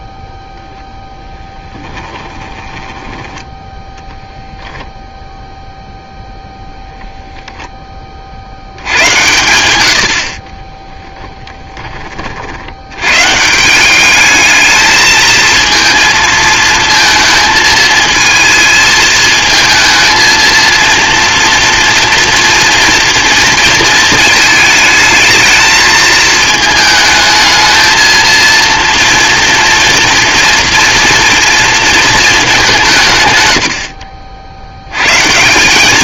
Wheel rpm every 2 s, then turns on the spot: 0, 10, 0, 0, 90, 20, 90, 220, 230, 220, 230, 230, 220, 220, 230, 230, 190, 80.
2-4 10-12